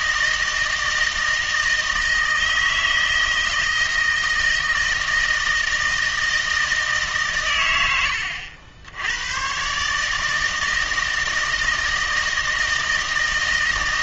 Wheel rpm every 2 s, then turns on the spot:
160, 160, 160, 160, 90, 160, 160.
none